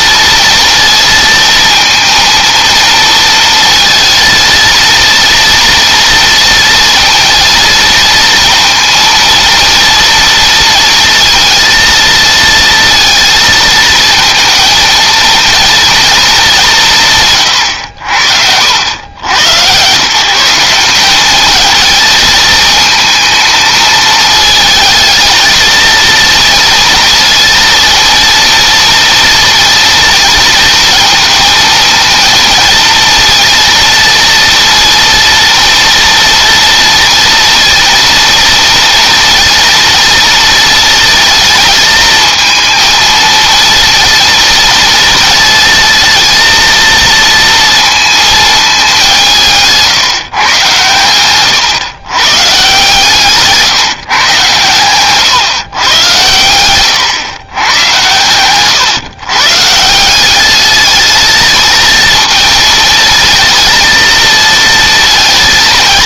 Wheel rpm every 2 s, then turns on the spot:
230, 230, 230, 230, 230, 230, 230, 230, 170, 80, 180, 220, 220, 230, 230, 230, 230, 230, 230, 230, 230, 220, 230, 230, 200, 120, 130, 120, 120, 130, 210, 230, 230.
52-54 56-58